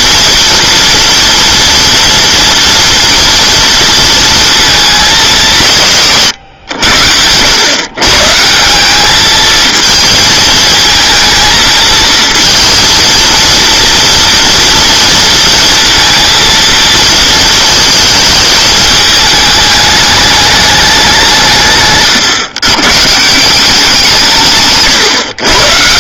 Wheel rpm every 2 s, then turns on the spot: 230, 230, 220, 100, 180, 220, 230, 230, 230, 220, 210, 130, 140.
none